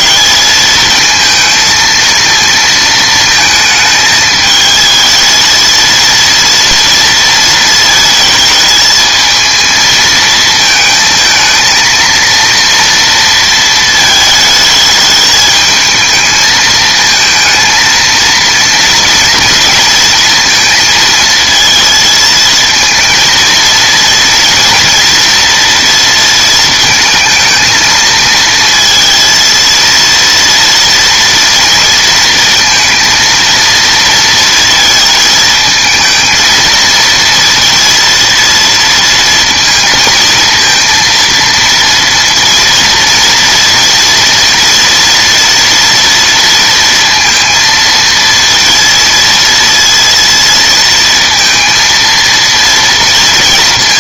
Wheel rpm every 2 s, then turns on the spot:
220, 220, 220, 230, 220, 220, 230, 220, 220, 230, 230, 220, 230, 230, 230, 230, 230, 230, 230, 230, 230, 230, 230, 230, 230, 230, 230.
none